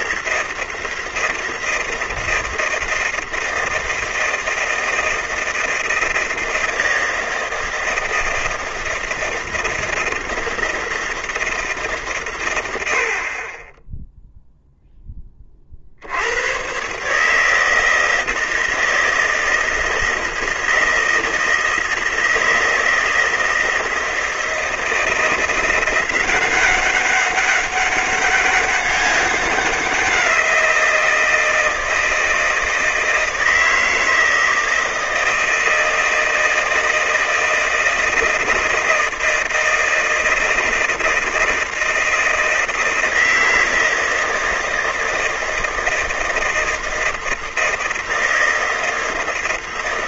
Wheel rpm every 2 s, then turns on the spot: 160, 160, 160, 160, 160, 160, 70, 10, 130, 160, 160, 160, 170, 190, 200, 170, 160, 160, 160, 160, 160, 160, 160, 160, 160.
none